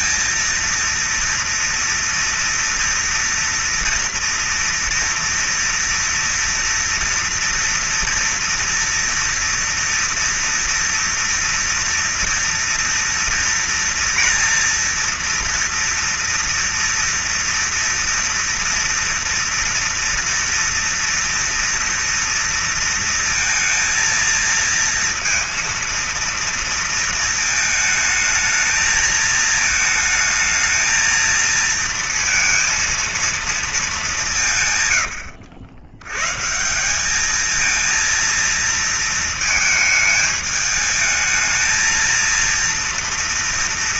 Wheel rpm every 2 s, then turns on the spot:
230, 230, 230, 230, 230, 230, 230, 230, 230, 230, 230, 230, 230, 230, 220, 220, 230, 200, 120, 230, 220, 230.
none